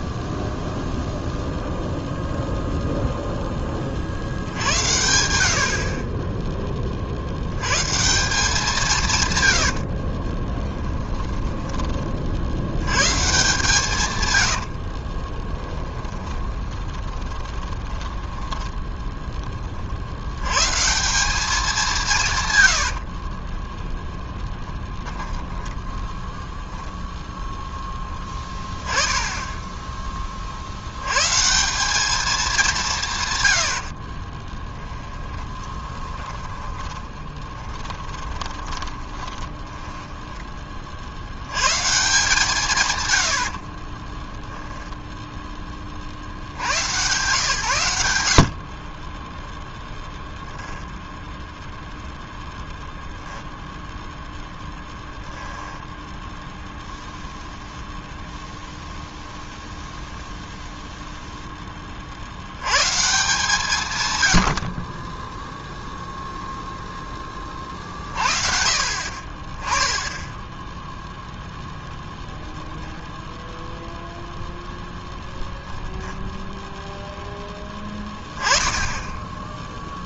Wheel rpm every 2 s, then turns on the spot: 0, 0, 80, 30, 170, 20, 110, 70, 20, 10, 140, 90, 10, 0, 10, 80, 180, 20, 20, 20, 50, 150, 0, 110, 20, 10, 0, 0, 0, 0, 0, 120, 40, 0, 50, 0, 10, 0, 0, 10.
10-12 14-20 22-24 34-40 50-52